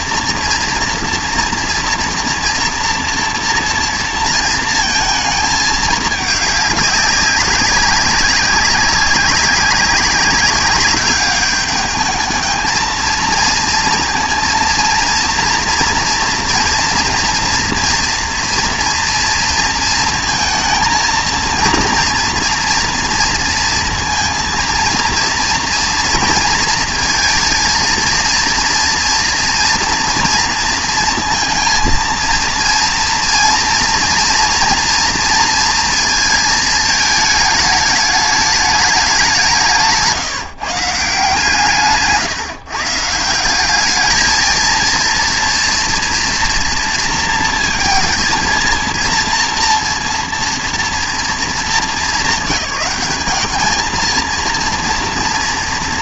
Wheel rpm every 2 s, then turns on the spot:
230, 230, 230, 210, 200, 200, 220, 230, 230, 240, 230, 230, 230, 240, 230, 230, 230, 230, 220, 210, 150, 140, 220, 230, 230, 230, 200, 230.
none